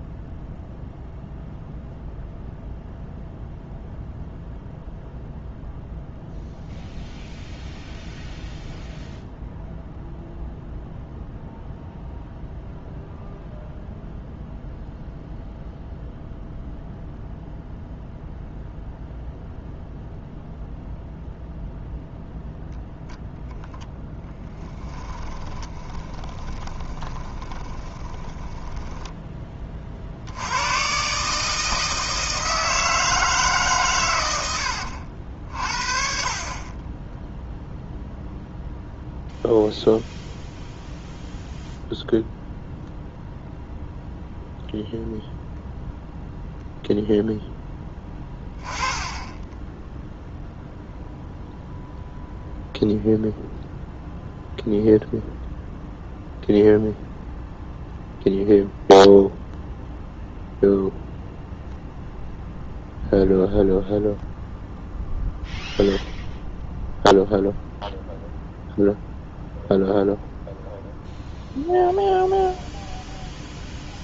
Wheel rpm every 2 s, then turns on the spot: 0, 0, 0, 0, 0, 0, 0, 0, 0, 0, 0, 0, 10, 20, 10, 100, 160, 80, 30, 0, 0, 0, 0, 0, 10, 0, 0, 0, 0, 0, 0, 0, 0, 0, 0, 0, 0.
24-30 34-36